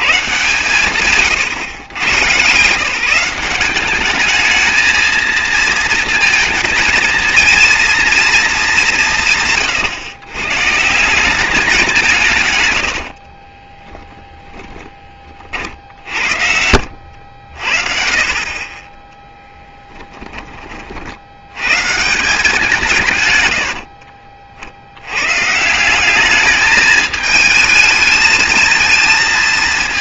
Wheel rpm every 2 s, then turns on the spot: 130, 150, 220, 220, 210, 140, 120, 20, 80, 30, 30, 170, 60, 210, 220.
14-18